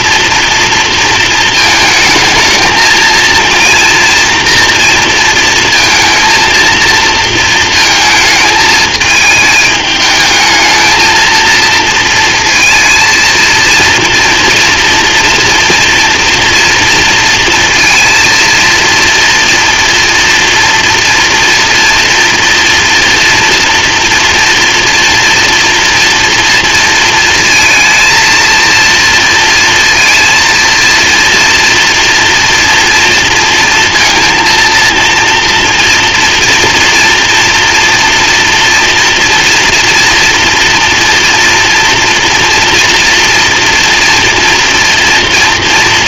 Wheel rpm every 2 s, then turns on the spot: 230, 220, 230, 230, 220, 220, 230, 230, 230, 230, 240, 240, 230, 230, 230, 230, 230, 220, 230, 230, 240, 240, 240.
none